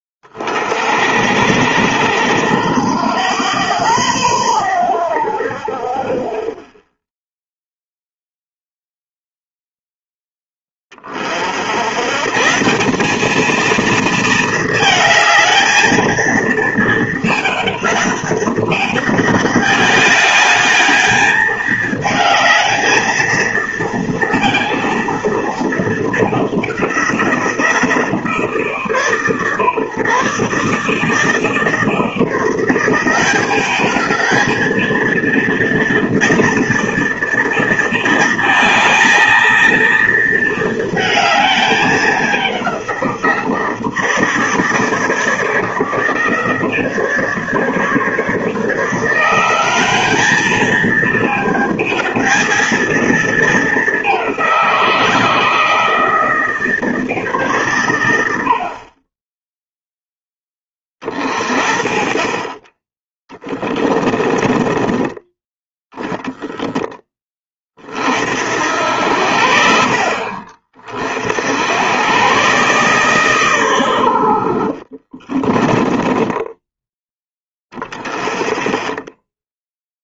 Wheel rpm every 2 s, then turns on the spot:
60, 90, 90, 10, 0, 20, 180, 220, 220, 200, 210, 220, 230, 190, 150, 150, 180, 220, 230, 220, 220, 180, 150, 160, 160, 220, 220, 170, 160, 60, 20, 20, 20, 10, 80, 40, 130, 50, 10, 10.
64-66 74-78